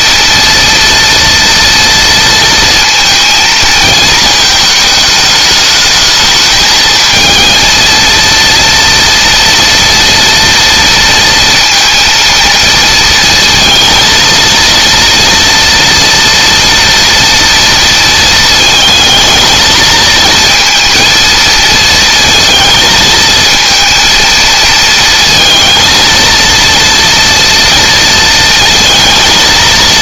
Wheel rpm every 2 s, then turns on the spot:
230, 230, 220, 220, 230, 230, 230, 230, 230, 220, 230, 230, 230, 230, 230.
none